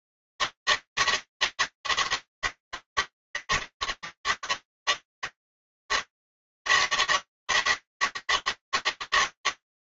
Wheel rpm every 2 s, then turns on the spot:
150, 150, 120, 150, 160.
none